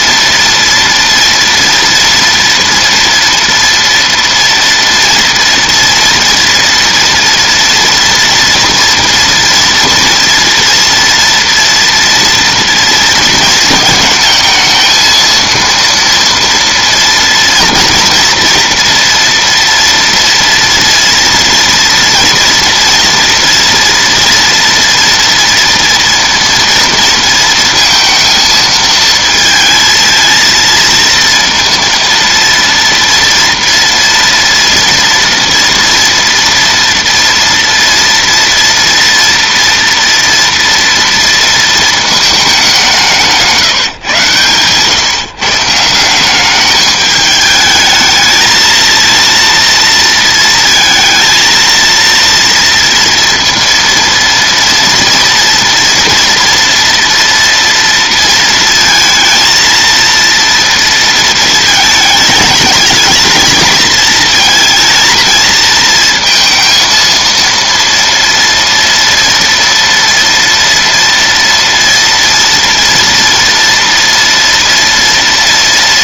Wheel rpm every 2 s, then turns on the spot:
230, 240, 230, 230, 230, 230, 230, 220, 230, 230, 230, 240, 230, 230, 230, 230, 230, 230, 230, 230, 230, 190, 130, 210, 220, 230, 230, 230, 240, 230, 230, 220, 230, 230, 230, 230, 230, 230.
none